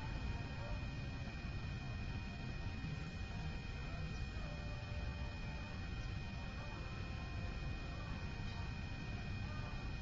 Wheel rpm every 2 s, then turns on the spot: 0, 0, 0, 0, 0.
none